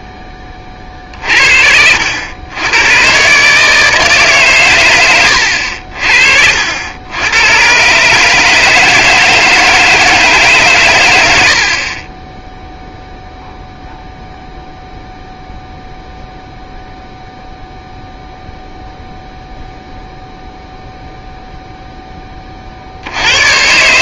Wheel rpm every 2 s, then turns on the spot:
30, 100, 120, 70, 160, 130, 0, 0, 0, 0, 0, 40.
none